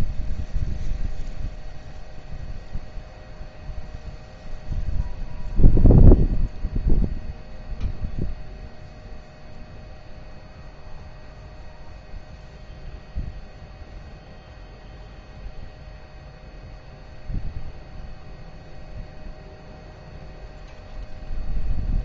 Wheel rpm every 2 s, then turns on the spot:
0, 0, 0, 0, 0, 0, 0, 0, 0, 0, 0.
none